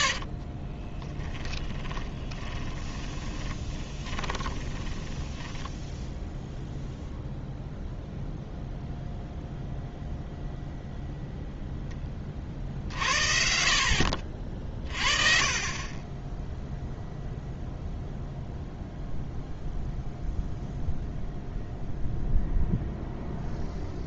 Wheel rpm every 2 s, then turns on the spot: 30, 20, 20, 0, 0, 0, 50, 40, 0, 0, 0, 0.
0-6